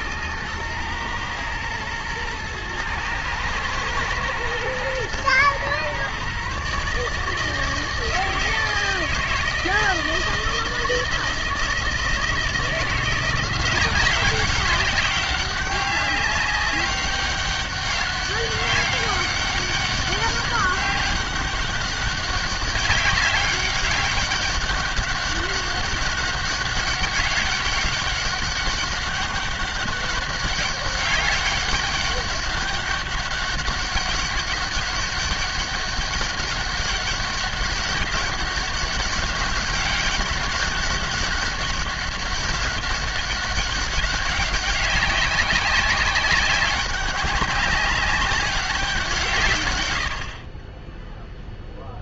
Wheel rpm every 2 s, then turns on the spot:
110, 110, 110, 140, 160, 160, 160, 190, 200, 200, 200, 200, 200, 200, 200, 200, 200, 200, 200, 200, 200, 200, 190, 190, 200, 30.
none